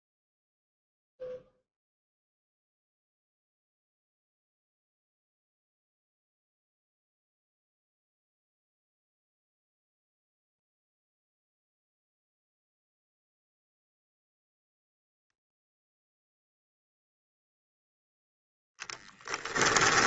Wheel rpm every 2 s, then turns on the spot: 0, 0, 0, 0, 0, 0, 0, 0, 0, 10.
18-20